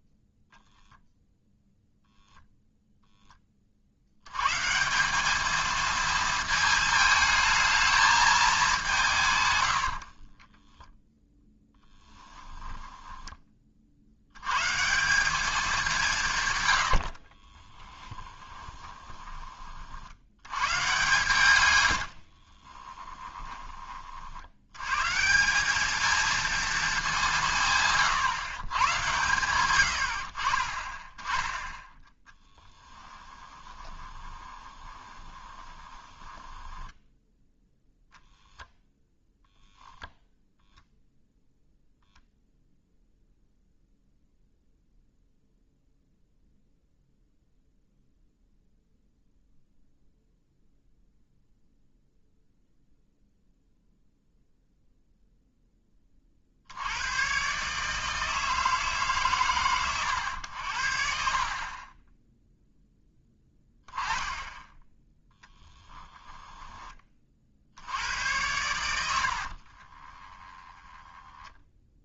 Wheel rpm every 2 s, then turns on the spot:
0, 0, 150, 220, 200, 10, 10, 140, 100, 20, 110, 30, 100, 220, 110, 30, 10, 20, 10, 0, 0, 0, 0, 0, 0, 0, 0, 0, 70, 160, 80, 0, 10, 20, 100, 20.
10-14 18-20 22-24 32-38 60-62 70-72